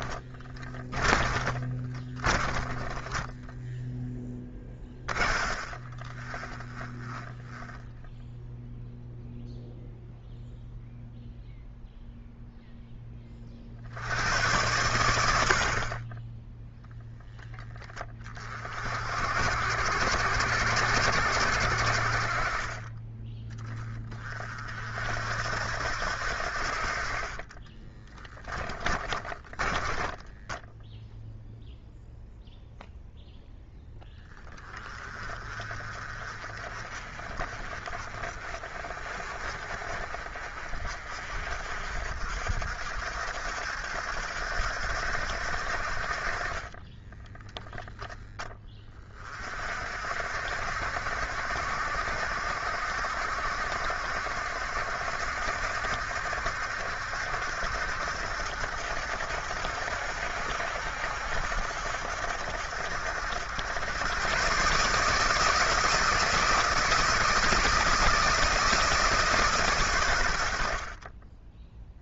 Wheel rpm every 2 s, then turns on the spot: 20, 20, 30, 20, 0, 0, 10, 100, 0, 60, 80, 20, 60, 40, 20, 0, 0, 30, 40, 40, 50, 60, 70, 20, 30, 60, 70, 70, 70, 70, 70, 80, 140, 160, 150, 30.
0-8 28-30 46-48